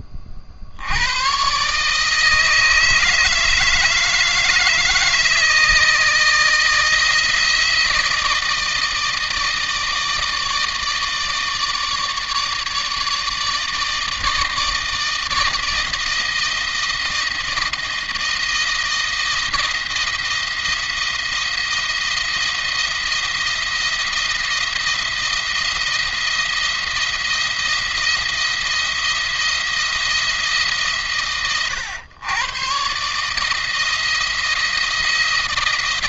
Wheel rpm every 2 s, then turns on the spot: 60, 160, 160, 160, 160, 160, 150, 160, 160, 160, 170, 170, 170, 170, 170, 160, 130, 160.
none